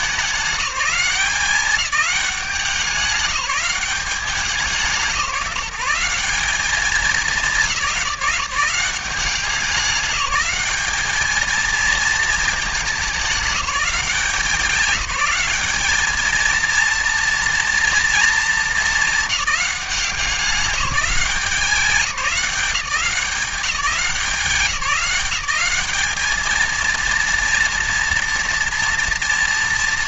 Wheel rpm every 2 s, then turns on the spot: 200, 180, 180, 200, 190, 210, 210, 180, 230, 220, 170, 170, 190, 230, 230.
none